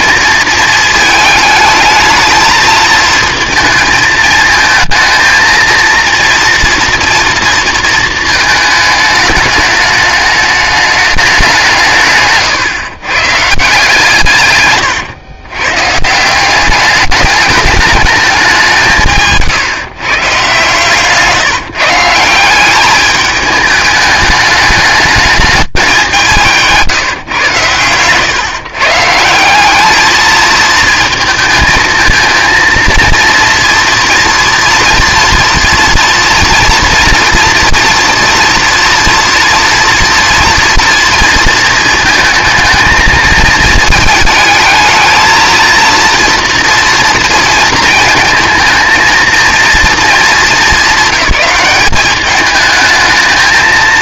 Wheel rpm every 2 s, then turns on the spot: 220, 220, 220, 240, 220, 210, 140, 130, 190, 180, 150, 190, 210, 170, 130, 220, 230, 230, 230, 230, 230, 220, 220, 230, 230, 200, 210.
none